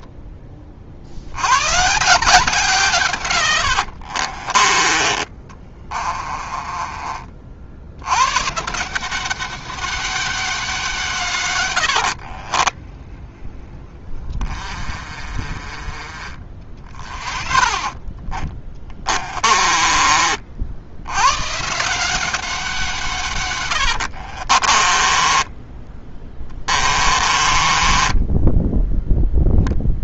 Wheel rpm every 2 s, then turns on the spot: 30, 150, 20, 30, 160, 190, 30, 40, 30, 20, 80, 180, 30, 20, 0.
6-8 12-20 24-28